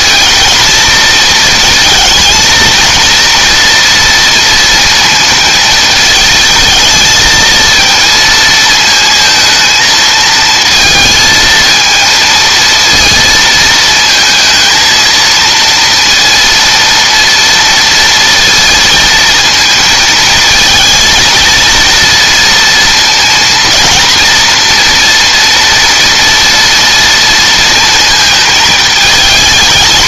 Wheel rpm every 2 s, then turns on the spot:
230, 230, 230, 220, 220, 230, 230, 230, 230, 230, 220, 230, 230, 230, 220.
none